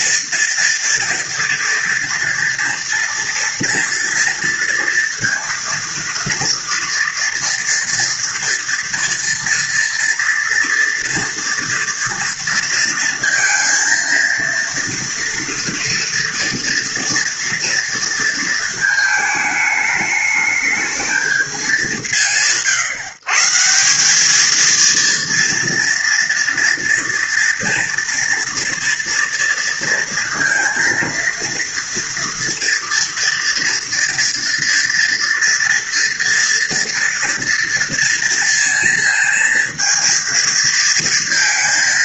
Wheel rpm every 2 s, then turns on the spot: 230, 230, 230, 230, 230, 230, 230, 230, 240, 220, 210, 140, 230, 230, 230, 230, 230, 230, 230, 230, 230.
none